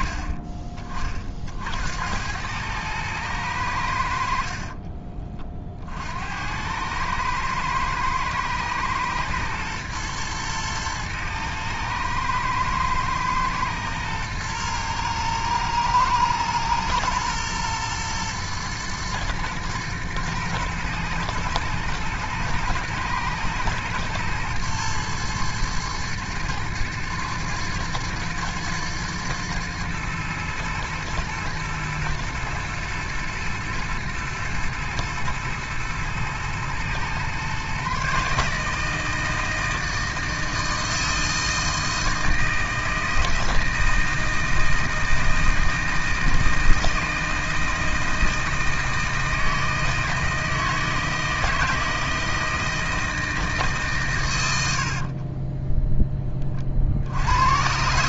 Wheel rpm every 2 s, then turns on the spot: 40, 110, 30, 100, 120, 110, 110, 110, 120, 110, 110, 110, 120, 110, 110, 110, 110, 110, 120, 160, 160, 160, 160, 160, 160, 160, 160, 60, 60.
4-6